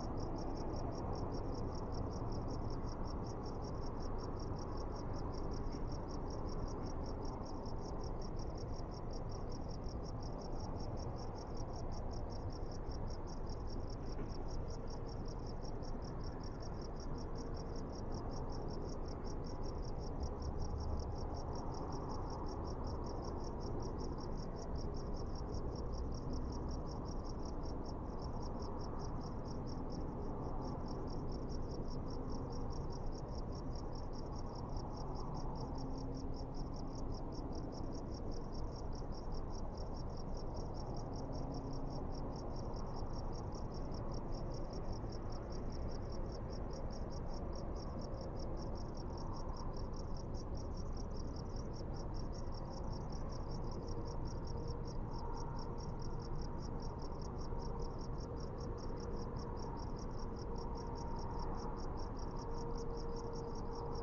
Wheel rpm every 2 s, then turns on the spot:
0, 0, 0, 0, 0, 0, 0, 0, 0, 0, 0, 0, 0, 0, 0, 0, 0, 0, 0, 0, 0, 0, 0, 0, 0, 0, 0, 0, 0, 0, 0, 0.
none